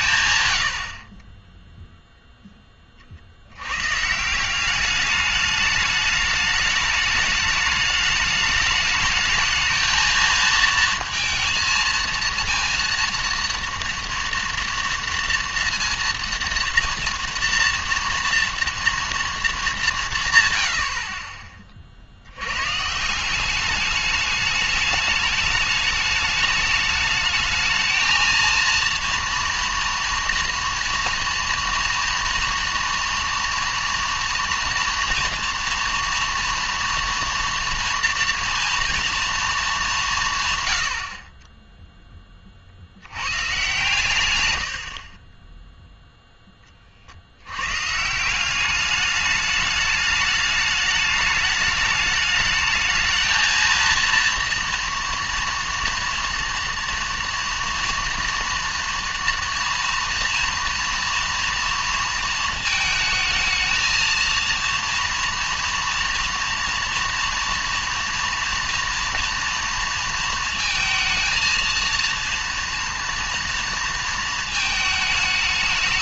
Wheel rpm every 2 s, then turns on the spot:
80, 20, 190, 210, 210, 230, 230, 230, 230, 230, 90, 140, 210, 210, 230, 230, 230, 230, 230, 230, 90, 60, 80, 30, 200, 210, 220, 230, 230, 230, 230, 220, 230, 230, 230, 220, 230, 220.
44-46